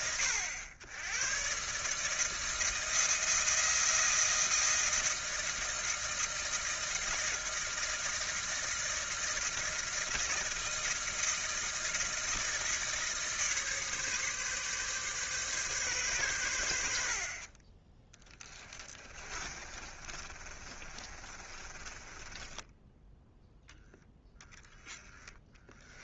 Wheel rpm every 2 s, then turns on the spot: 100, 160, 160, 160, 160, 160, 160, 140, 70, 20, 30, 10, 10.
18-22 24-26